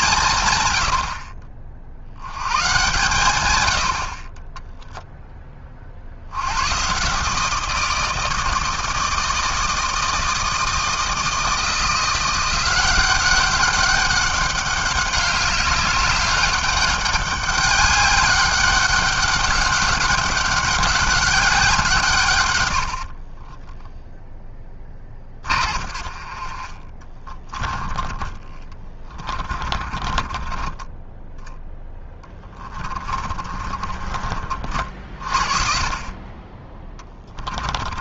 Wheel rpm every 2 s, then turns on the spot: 120, 110, 20, 100, 160, 160, 180, 190, 200, 200, 200, 140, 10, 40, 30, 20, 20, 50, 30.
24-26 28-34